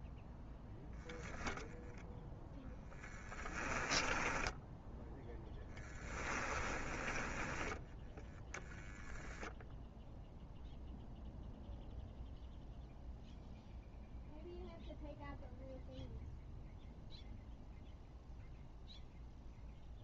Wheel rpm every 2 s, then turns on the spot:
10, 10, 0, 10, 0, 0, 0, 0, 0, 0.
2-4